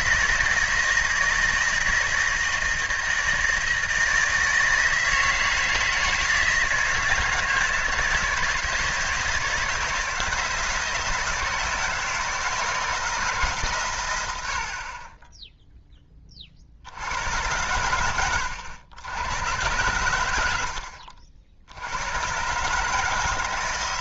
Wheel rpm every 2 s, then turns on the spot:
160, 160, 160, 160, 160, 170, 160, 60, 50, 100, 80, 140.
none